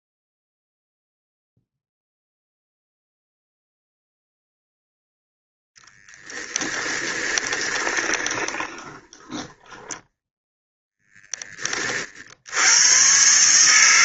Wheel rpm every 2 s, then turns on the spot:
0, 0, 0, 20, 10, 10, 130.
6-10